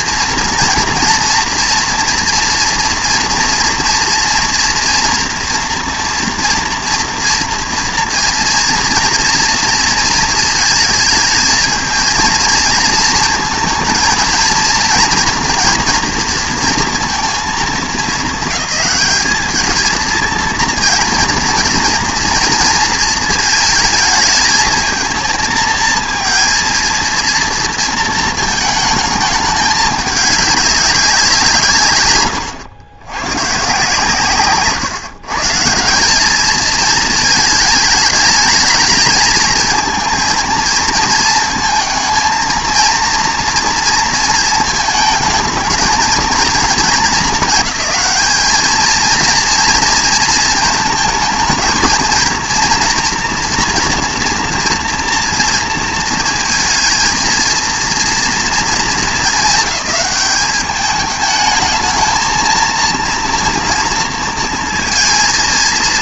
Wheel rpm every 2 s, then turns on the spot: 230, 240, 230, 230, 230, 220, 230, 230, 230, 200, 230, 230, 220, 230, 220, 200, 90, 130, 220, 220, 230, 230, 220, 230, 230, 220, 230, 230, 220, 230, 210, 230, 230.
none